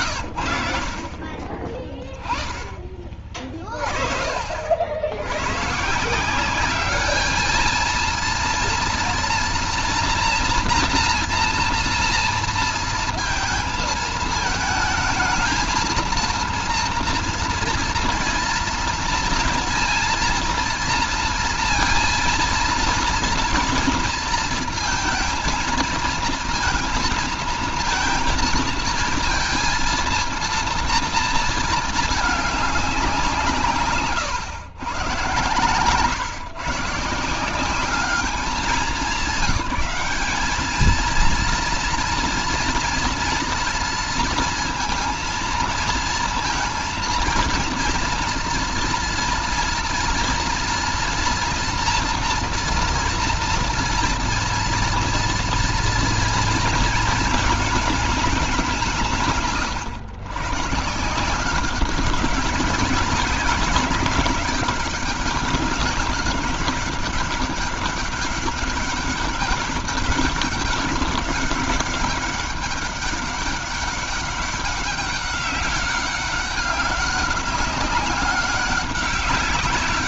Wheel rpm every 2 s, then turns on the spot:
60, 20, 60, 200, 240, 230, 230, 220, 230, 230, 230, 230, 230, 230, 220, 230, 190, 100, 150, 200, 220, 240, 230, 230, 240, 230, 230, 230, 220, 170, 150, 200, 200, 200, 190, 200, 200, 200, 190, 200.
none